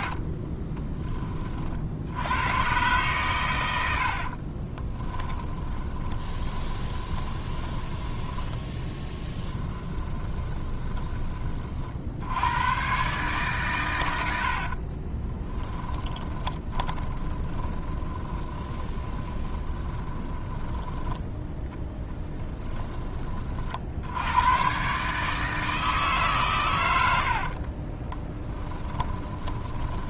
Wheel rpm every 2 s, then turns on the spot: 10, 120, 30, 10, 10, 20, 110, 50, 20, 20, 10, 20, 130, 100, 10.
0-2 4-12 14-24 28-30